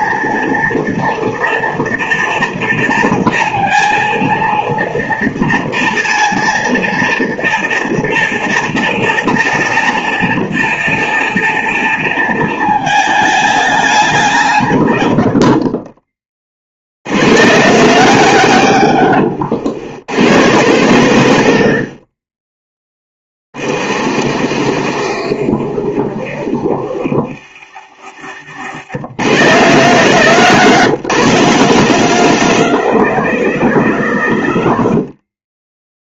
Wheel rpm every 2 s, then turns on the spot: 230, 230, 230, 230, 230, 230, 220, 150, 50, 160, 120, 30, 70, 70, 70, 170, 180, 110.
24-28